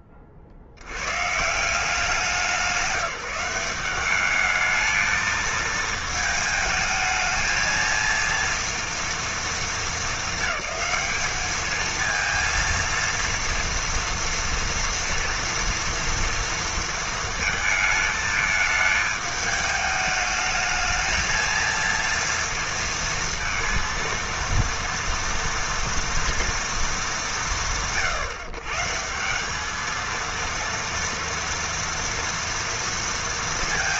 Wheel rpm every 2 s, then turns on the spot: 50, 180, 220, 220, 230, 210, 230, 230, 230, 220, 220, 230, 230, 150, 160, 230, 230.
none